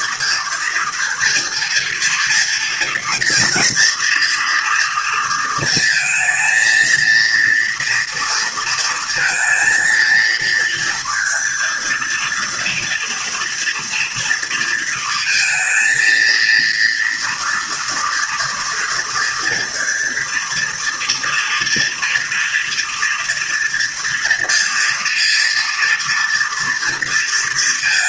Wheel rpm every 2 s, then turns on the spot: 230, 230, 240, 230, 230, 230, 230, 230, 230, 230, 230, 230, 230, 230.
none